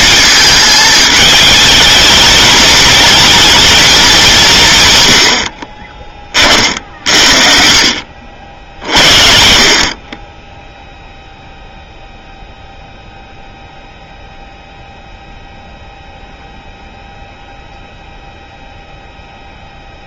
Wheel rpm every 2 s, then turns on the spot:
210, 220, 160, 40, 50, 0, 0, 0, 0, 0.
none